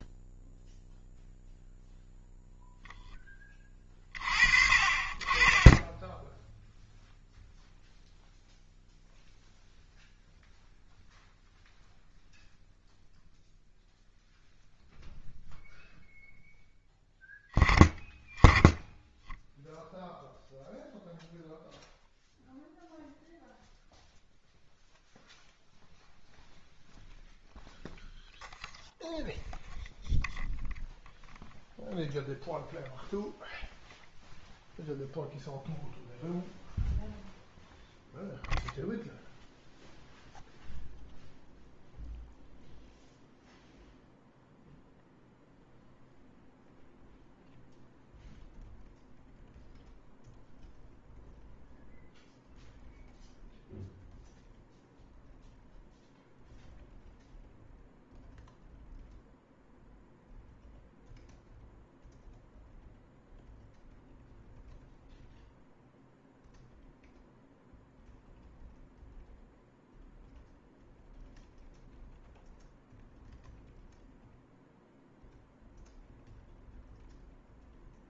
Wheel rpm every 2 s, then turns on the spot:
0, 0, 30, 0, 0, 0, 0, 0, 0, 10, 0, 0, 0, 0, 0, 0, 0, 0, 0, 0, 0, 0, 0, 0, 0, 0, 0, 0, 0, 0, 0, 0, 0, 0, 0, 0, 0, 0, 0.
none